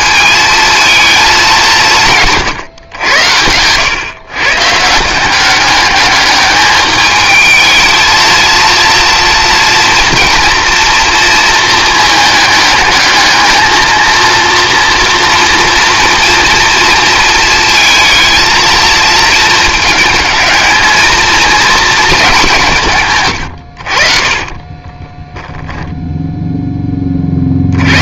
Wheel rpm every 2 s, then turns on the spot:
230, 130, 150, 210, 230, 230, 210, 230, 230, 230, 220, 160, 20, 10.
24-26